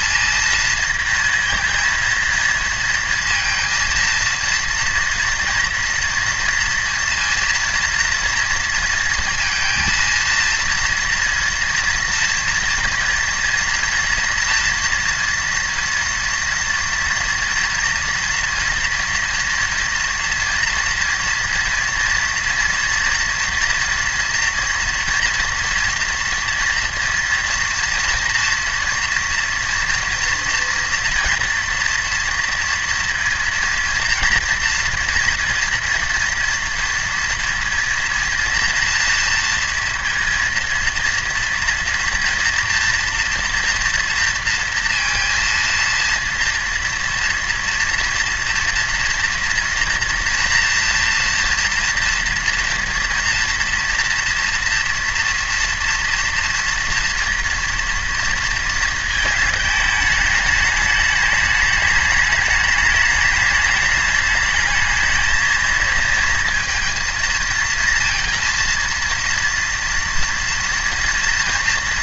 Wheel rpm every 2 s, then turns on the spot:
230, 230, 230, 230, 230, 230, 230, 230, 240, 240, 230, 230, 240, 230, 230, 230, 230, 230, 230, 230, 230, 240, 230, 230, 230, 230, 230, 230, 230, 230, 210, 210, 210, 230, 230, 230.
none